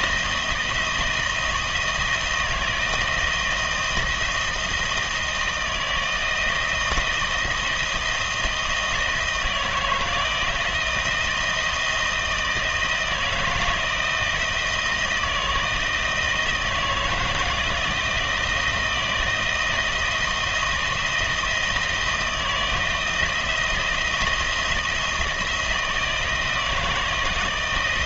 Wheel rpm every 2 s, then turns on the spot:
160, 160, 160, 160, 160, 160, 160, 160, 160, 160, 160, 160, 170, 170.
none